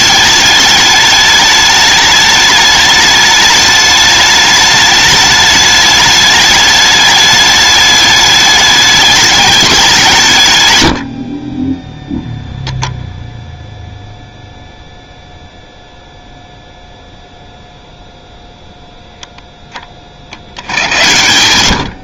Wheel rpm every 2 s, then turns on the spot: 210, 210, 210, 210, 210, 130, 0, 0, 0, 0, 60.
none